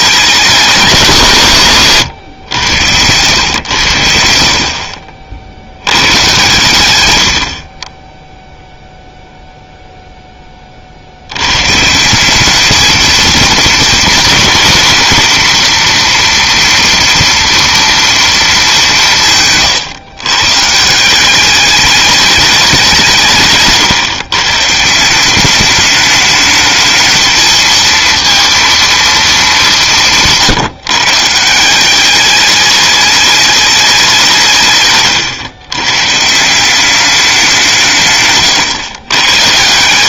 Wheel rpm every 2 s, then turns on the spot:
200, 100, 50, 110, 0, 30, 210, 230, 240, 210, 150, 200, 150, 220, 230, 160, 210, 140, 180, 120.
none